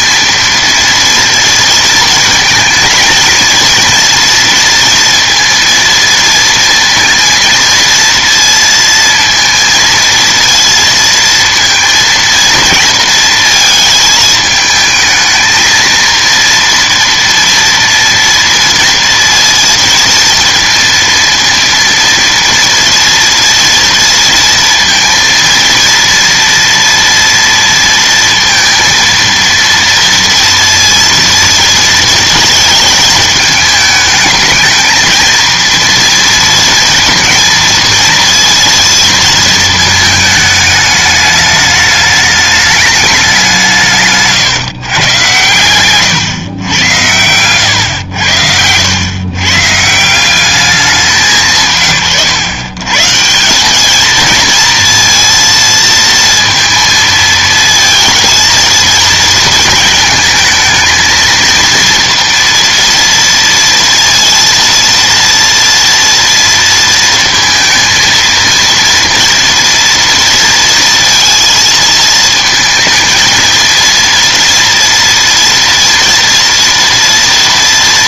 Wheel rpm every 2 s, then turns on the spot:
230, 230, 230, 230, 230, 230, 230, 220, 230, 230, 230, 230, 230, 230, 230, 230, 220, 220, 230, 230, 210, 210, 140, 110, 90, 200, 120, 230, 230, 230, 220, 240, 230, 230, 230, 230, 220, 230, 230.
none